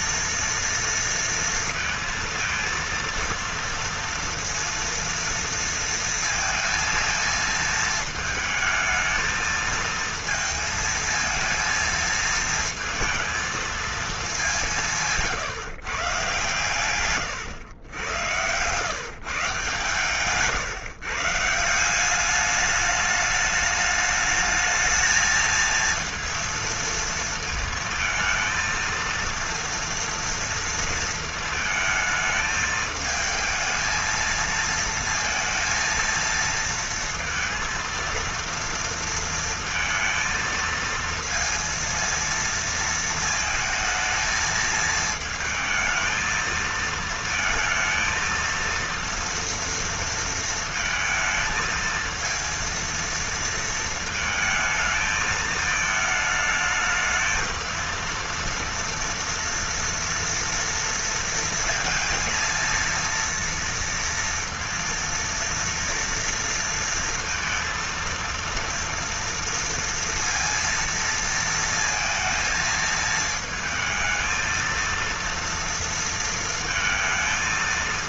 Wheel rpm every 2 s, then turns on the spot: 230, 230, 230, 230, 220, 220, 230, 190, 130, 120, 150, 210, 220, 230, 230, 230, 220, 230, 230, 230, 230, 230, 220, 220, 230, 220, 230, 220, 220, 230, 230, 230, 230, 230, 230, 230, 220, 230, 230.
none